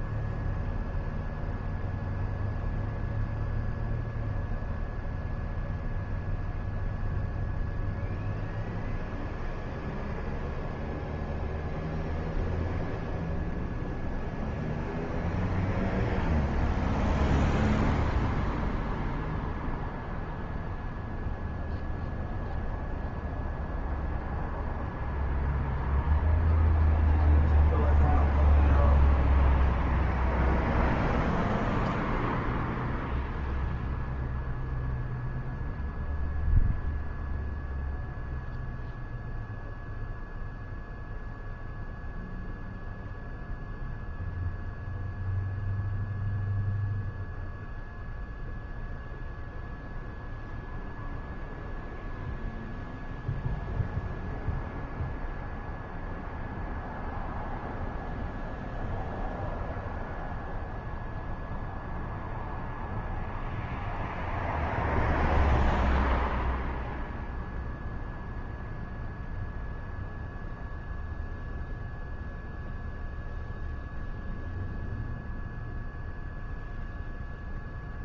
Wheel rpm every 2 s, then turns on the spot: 0, 0, 0, 0, 0, 0, 0, 0, 0, 0, 0, 0, 0, 0, 0, 0, 0, 0, 0, 0, 0, 0, 0, 0, 0, 0, 0, 0, 0, 0, 0, 0, 0, 0, 0, 0, 0, 0, 0.
none